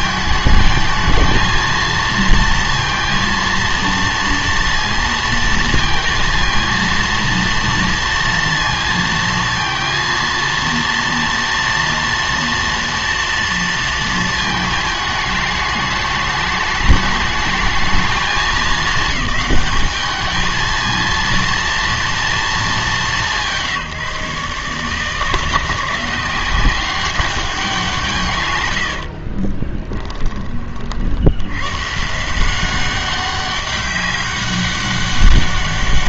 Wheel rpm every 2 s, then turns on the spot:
220, 230, 230, 230, 230, 230, 230, 220, 210, 210, 220, 210, 150, 180, 100, 30, 180, 200.
28-30